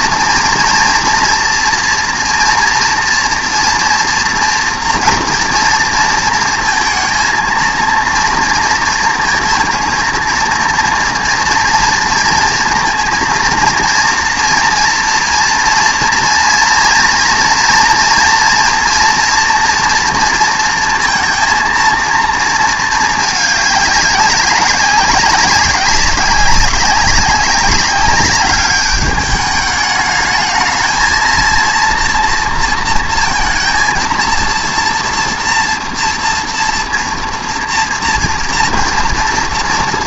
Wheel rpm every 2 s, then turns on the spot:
230, 230, 240, 230, 230, 230, 230, 230, 230, 230, 230, 230, 190, 190, 200, 220, 230, 230, 240, 230.
none